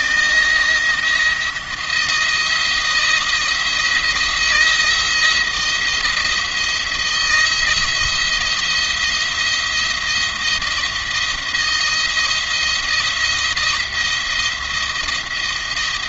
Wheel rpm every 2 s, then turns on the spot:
170, 170, 170, 170, 170, 170, 170, 170.
none